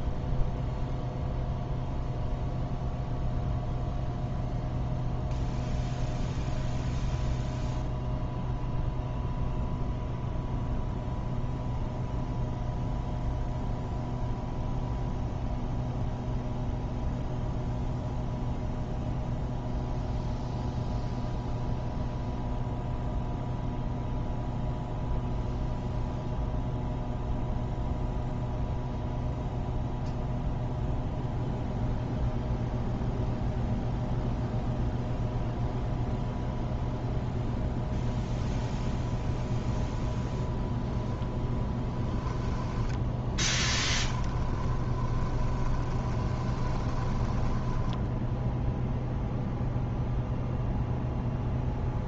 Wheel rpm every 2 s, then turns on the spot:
0, 0, 0, 0, 0, 0, 0, 0, 0, 0, 0, 0, 0, 0, 0, 0, 0, 0, 0, 0, 0, 10, 20, 20, 0, 0.
42-48